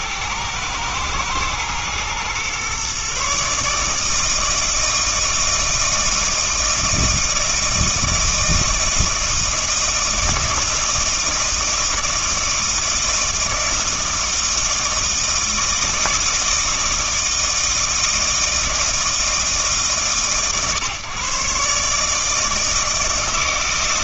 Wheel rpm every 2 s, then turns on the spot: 110, 130, 160, 160, 160, 160, 160, 160, 160, 160, 120, 160.
none